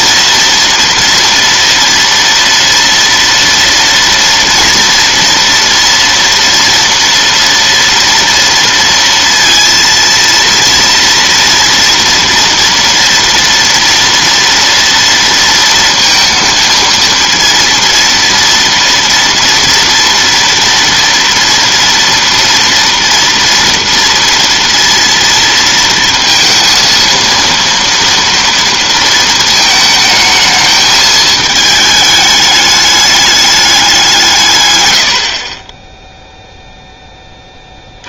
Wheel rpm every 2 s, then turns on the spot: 230, 230, 230, 230, 230, 230, 230, 230, 230, 230, 230, 230, 230, 230, 230, 220, 210, 120, 0.
none